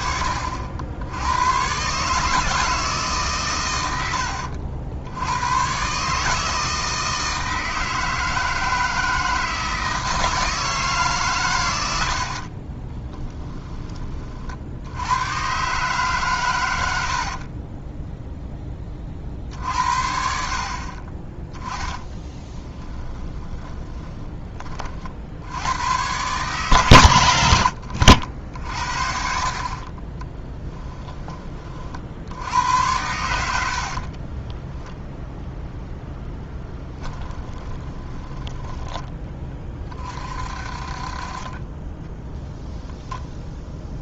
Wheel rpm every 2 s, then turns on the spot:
70, 150, 70, 160, 160, 160, 30, 70, 90, 20, 40, 10, 30, 130, 60, 10, 90, 10, 20, 20, 40, 0.
12-14 22-24 30-32 36-40